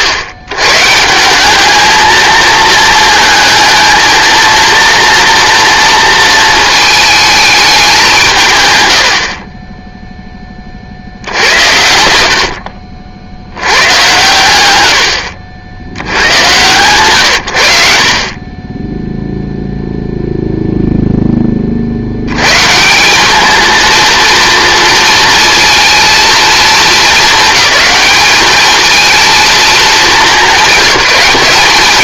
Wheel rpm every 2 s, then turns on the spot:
130, 220, 230, 220, 120, 50, 60, 110, 110, 10, 0, 130, 230, 220, 210, 190.
18-20